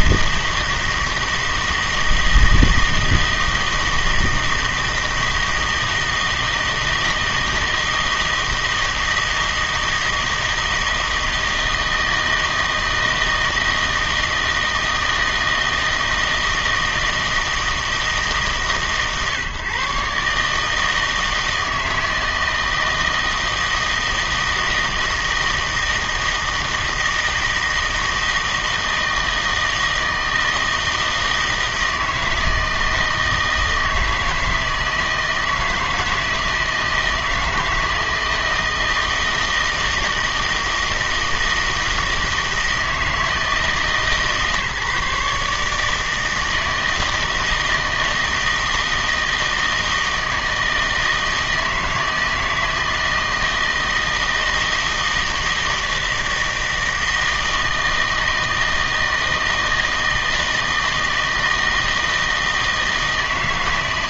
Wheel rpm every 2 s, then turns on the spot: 160, 160, 160, 160, 160, 160, 160, 160, 160, 140, 160, 160, 160, 160, 160, 160, 160, 160, 160, 160, 160, 160, 150, 160, 160, 160, 160, 160, 160, 160, 160, 160.
none